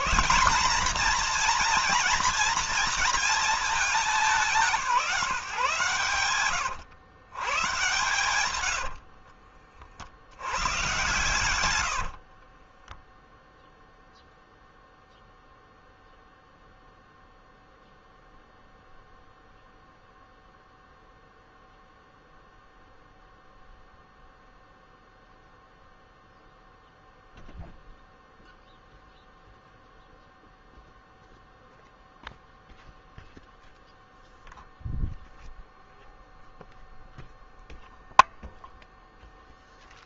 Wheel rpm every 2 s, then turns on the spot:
210, 220, 160, 110, 70, 110, 20, 0, 0, 0, 0, 0, 0, 0, 0, 0, 0, 0, 0, 0.
8-10 12-14